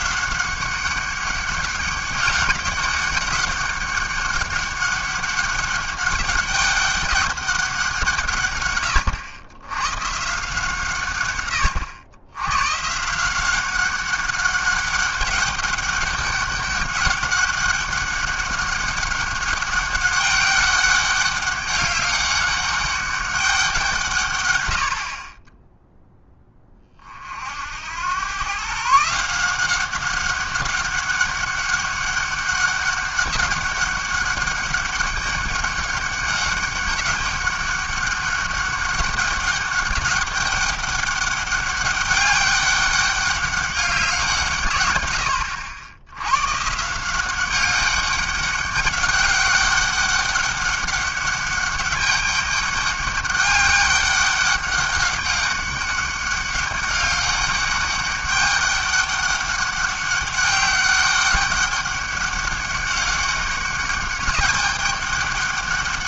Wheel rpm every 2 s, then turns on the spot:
190, 200, 200, 200, 130, 150, 120, 200, 200, 200, 200, 200, 100, 20, 130, 200, 200, 200, 200, 200, 200, 200, 150, 120, 200, 200, 200, 200, 200, 200, 200, 200, 200.
none